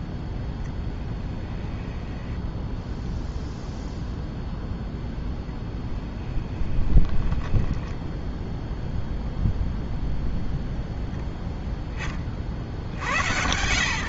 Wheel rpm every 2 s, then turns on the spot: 10, 10, 0, 20, 0, 0, 60.
2-4 6-8